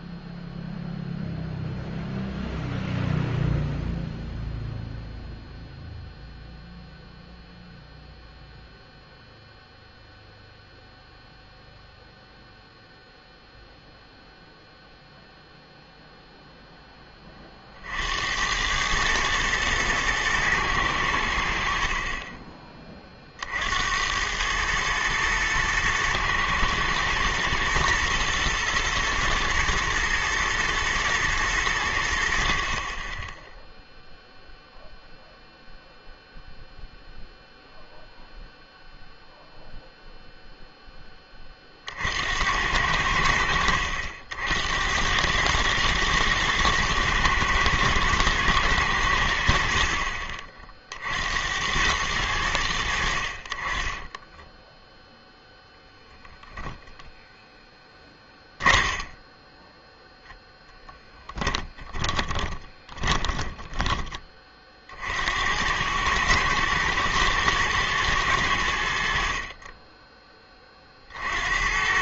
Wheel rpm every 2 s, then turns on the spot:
0, 0, 0, 0, 0, 0, 0, 0, 30, 110, 70, 40, 110, 120, 120, 110, 0, 0, 0, 0, 10, 80, 100, 110, 80, 60, 60, 0, 0, 20, 10, 20, 50, 110, 80, 40.
58-64